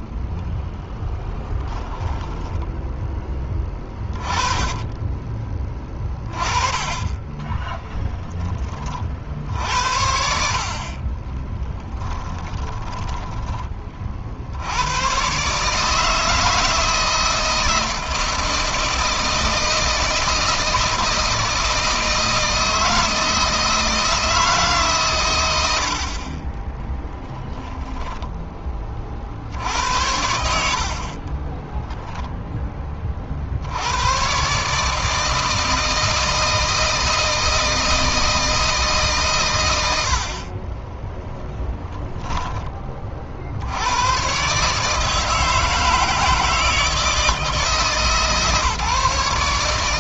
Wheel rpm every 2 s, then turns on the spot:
0, 10, 20, 20, 20, 60, 20, 80, 160, 160, 160, 160, 150, 20, 20, 60, 20, 140, 160, 150, 30, 20, 140, 160, 150.
8-10 12-14 26-28